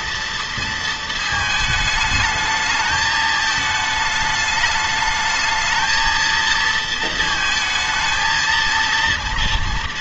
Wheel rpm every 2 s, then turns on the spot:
230, 220, 210, 230, 230.
none